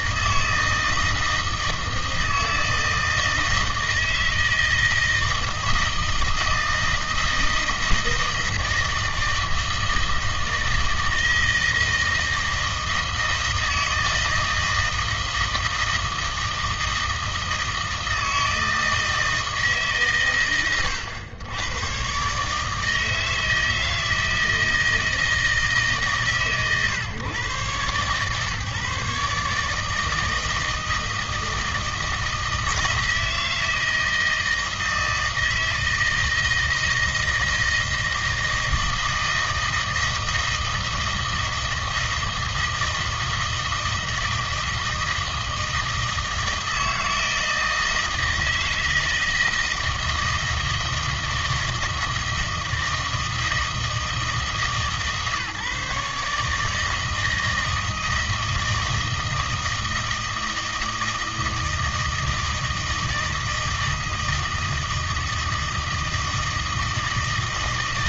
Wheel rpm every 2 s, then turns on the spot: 160, 160, 160, 160, 160, 160, 160, 160, 160, 160, 120, 150, 160, 130, 130, 160, 160, 160, 160, 160, 160, 160, 160, 160, 160, 160, 160, 160, 160, 160, 160, 160, 160, 160.
none